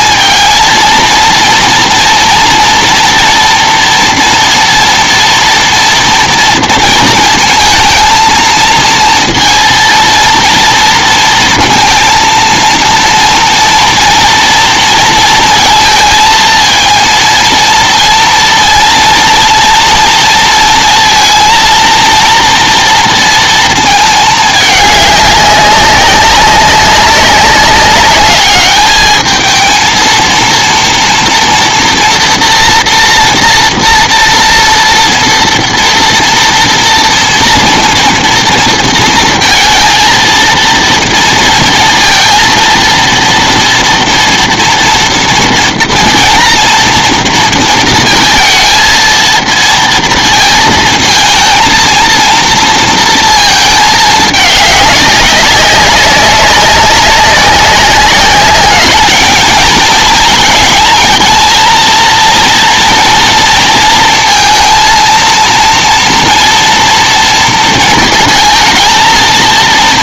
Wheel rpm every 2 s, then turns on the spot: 230, 230, 230, 230, 230, 230, 230, 230, 230, 230, 230, 240, 210, 190, 210, 230, 230, 230, 230, 230, 230, 230, 230, 230, 230, 220, 230, 210, 190, 200, 230, 230, 230, 230, 220.
none